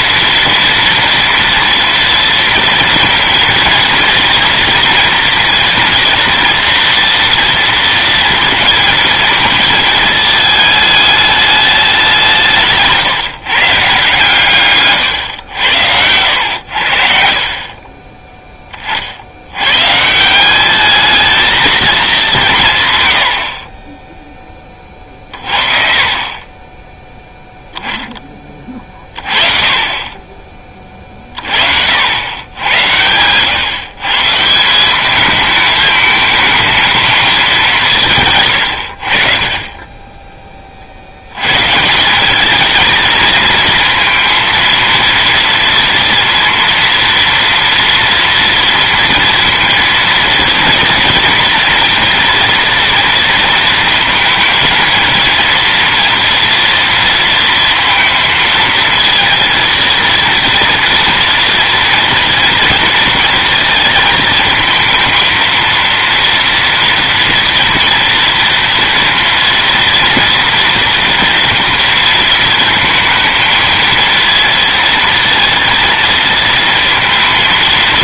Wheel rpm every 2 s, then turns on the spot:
230, 230, 230, 230, 230, 210, 150, 130, 90, 30, 200, 160, 20, 20, 20, 20, 90, 170, 220, 100, 30, 210, 230, 230, 230, 230, 230, 230, 230, 230, 230, 230, 230, 230, 230, 230, 220, 230, 230.
none